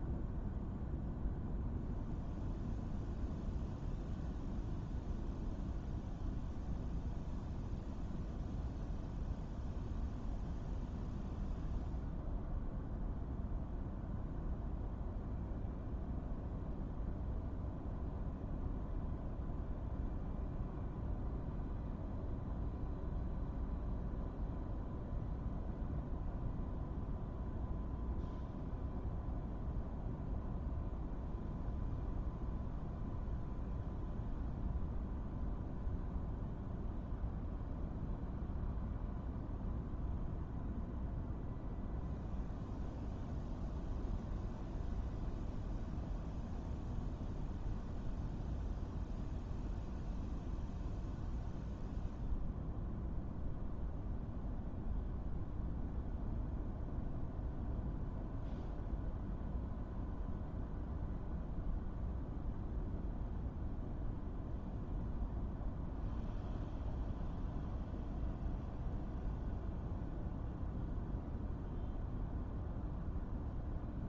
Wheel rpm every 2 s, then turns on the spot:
0, 0, 0, 0, 0, 0, 0, 0, 0, 0, 0, 0, 0, 0, 0, 0, 0, 0, 0, 0, 0, 0, 0, 0, 0, 0, 0, 0, 0, 0, 0, 0, 0, 0, 0, 0, 0.
none